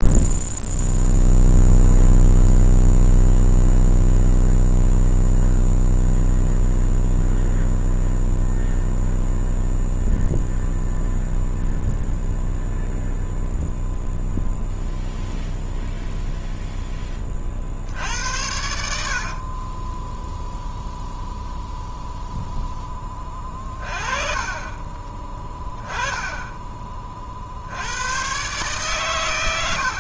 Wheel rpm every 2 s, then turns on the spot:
0, 0, 0, 0, 0, 0, 0, 0, 0, 70, 0, 0, 30, 20, 130.
none